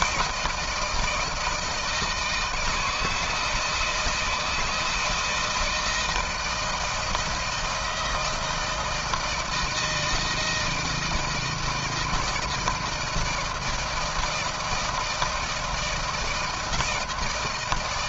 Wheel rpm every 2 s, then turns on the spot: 170, 160, 160, 160, 160, 160, 160, 160, 160.
none